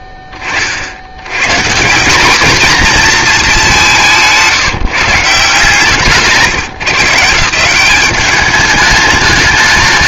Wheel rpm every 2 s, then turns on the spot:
20, 220, 180, 170, 210.
none